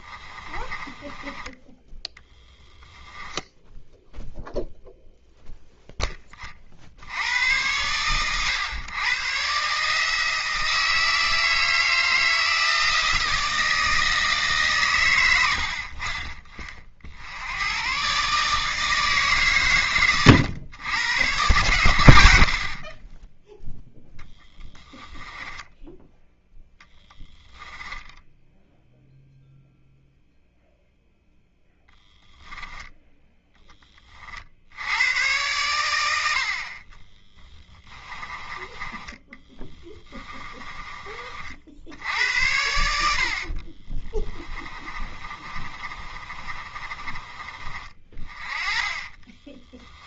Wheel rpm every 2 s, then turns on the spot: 20, 10, 0, 80, 120, 160, 160, 120, 40, 160, 110, 40, 10, 10, 0, 0, 10, 80, 40, 20, 20, 80, 30, 30, 30.
0-4 24-28 42-50